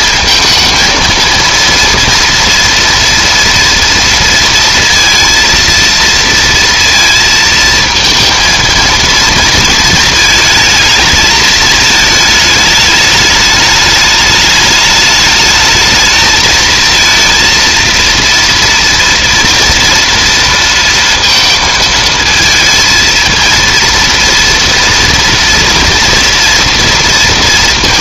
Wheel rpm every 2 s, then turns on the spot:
230, 230, 230, 230, 230, 220, 210, 220, 230, 230, 230, 220, 230, 230.
none